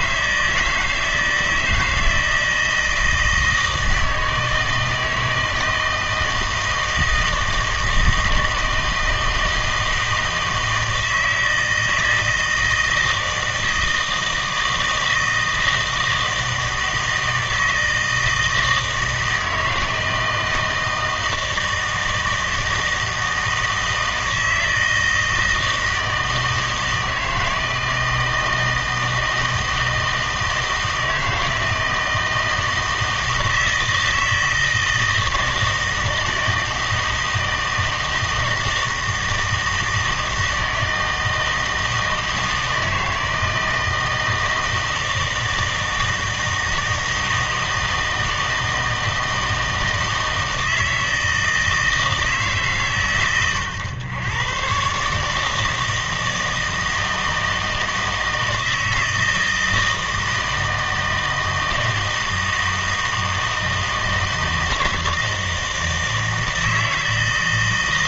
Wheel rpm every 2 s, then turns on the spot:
160, 160, 160, 160, 160, 160, 160, 160, 160, 160, 160, 160, 160, 160, 160, 160, 160, 160, 160, 160, 160, 160, 160, 160, 160, 160, 140, 130, 160, 160, 160, 160, 160, 160.
none